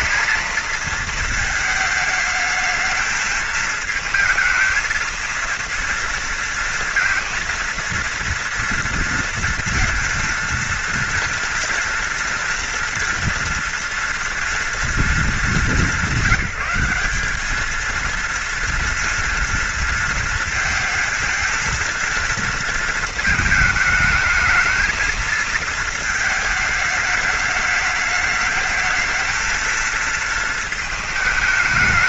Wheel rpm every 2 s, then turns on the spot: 220, 220, 220, 230, 230, 230, 230, 230, 180, 230, 230, 230, 220, 220, 210, 220.
none